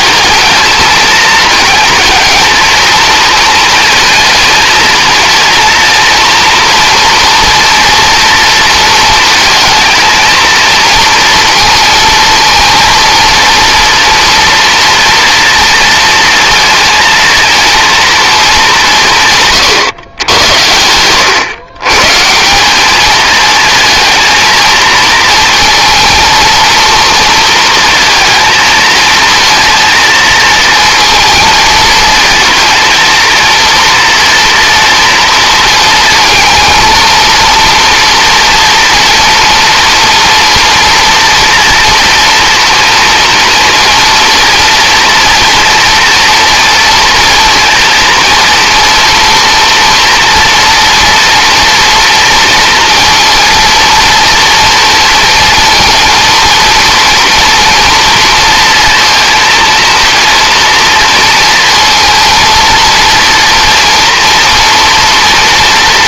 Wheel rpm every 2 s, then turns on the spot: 220, 230, 220, 230, 230, 230, 230, 230, 230, 180, 110, 200, 230, 230, 220, 230, 230, 230, 230, 230, 240, 230, 230, 230, 230, 230, 230, 230, 230, 230, 230, 230, 230.
none